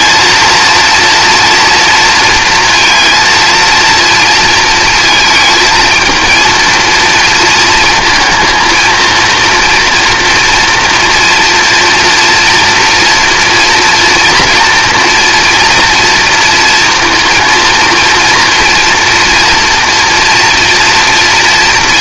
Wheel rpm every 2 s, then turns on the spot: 230, 230, 230, 230, 230, 240, 230, 230, 230, 240, 240.
none